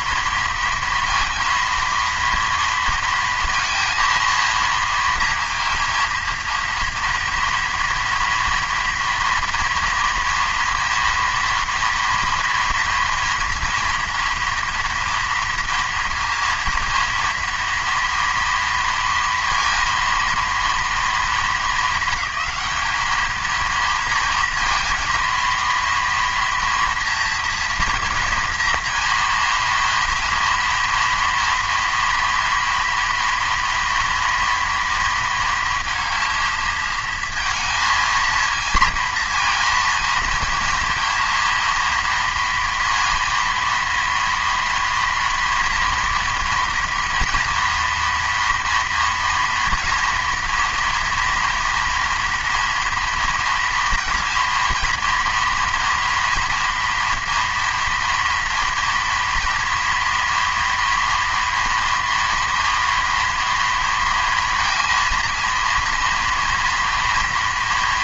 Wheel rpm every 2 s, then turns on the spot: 230, 230, 230, 230, 240, 230, 230, 230, 230, 230, 230, 210, 230, 230, 230, 240, 240, 230, 220, 230, 230, 230, 230, 230, 230, 230, 230, 230, 230, 230, 230, 240, 230, 240.
none